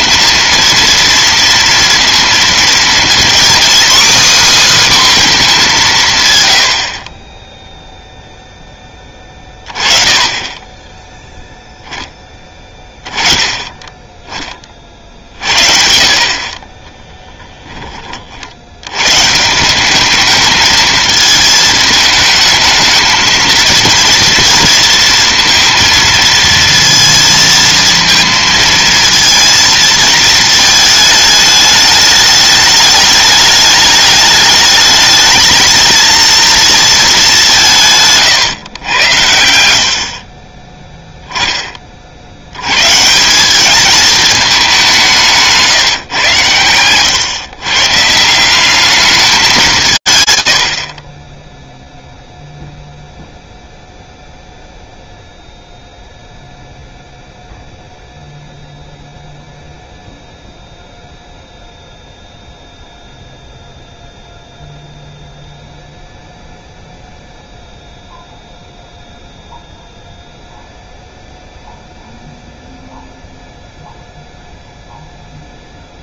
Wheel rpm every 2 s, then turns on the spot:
230, 230, 280, 80, 0, 30, 10, 30, 40, 60, 220, 220, 230, 230, 230, 220, 210, 210, 230, 140, 30, 90, 210, 120, 180, 130, 0, 0, 0, 0, 0, 0, 0, 0, 0, 0, 0, 0.
38-40